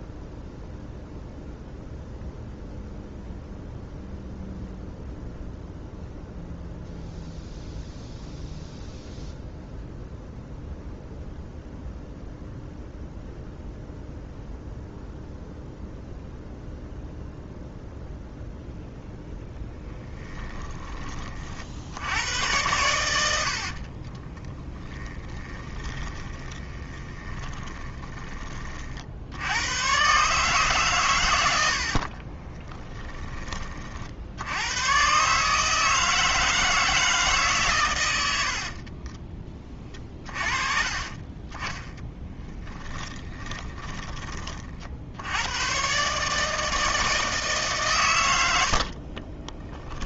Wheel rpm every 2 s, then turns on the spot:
0, 0, 0, 0, 0, 0, 0, 0, 0, 0, 10, 100, 10, 20, 50, 130, 20, 100, 160, 50, 30, 10, 50, 160, 50.
24-28 32-34 38-40 42-44 48-50